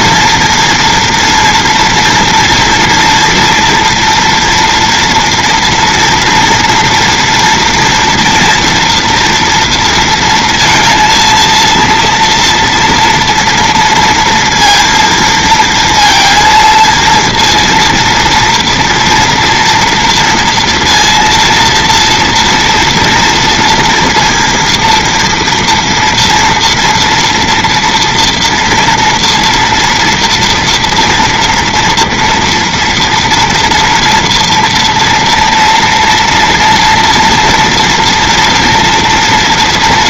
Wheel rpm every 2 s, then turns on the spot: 230, 240, 230, 230, 230, 230, 230, 230, 230, 230, 230, 230, 230, 240, 230, 230, 230, 230, 230, 230.
none